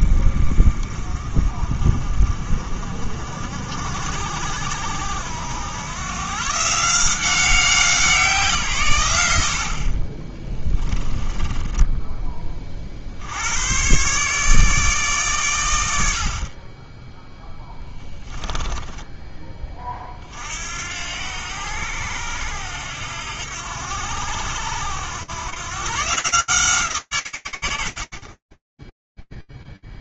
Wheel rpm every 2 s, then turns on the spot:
40, 50, 80, 170, 110, 20, 50, 150, 20, 10, 70, 80, 90, 150, 0.
10-12 18-20